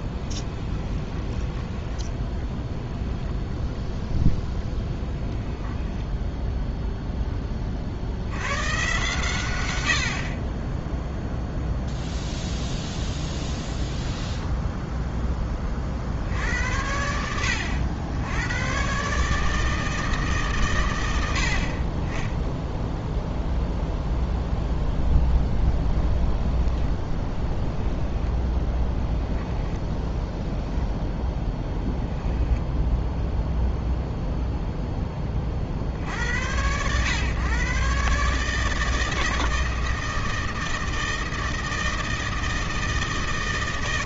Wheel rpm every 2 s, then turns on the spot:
20, 0, 10, 0, 120, 20, 10, 10, 70, 110, 120, 0, 0, 10, 10, 10, 0, 0, 100, 150, 160, 160.
0-2 4-6 12-16 26-30